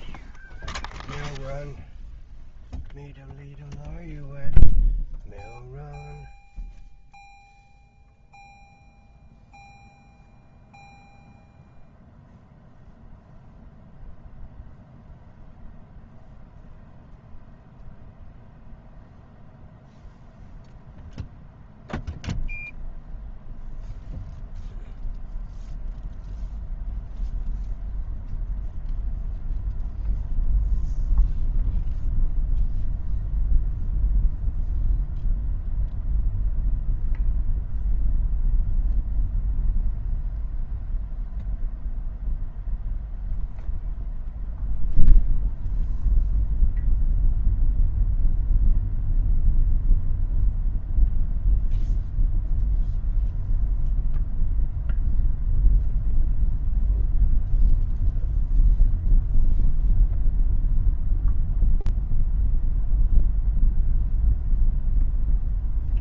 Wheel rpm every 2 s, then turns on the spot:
0, 0, 0, 0, 0, 0, 0, 0, 0, 0, 0, 0, 0, 0, 0, 0, 0, 0, 0, 0, 0, 0, 0, 0, 0, 0, 0, 0, 0, 0, 0, 0, 0.
none